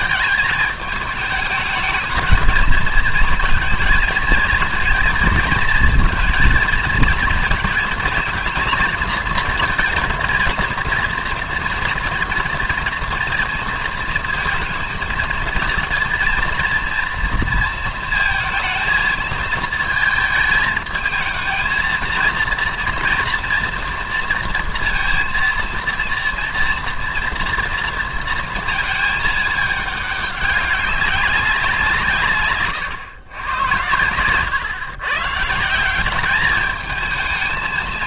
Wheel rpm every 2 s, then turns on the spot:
210, 220, 230, 230, 230, 230, 230, 230, 230, 230, 220, 230, 230, 230, 230, 200, 120, 120, 210.
none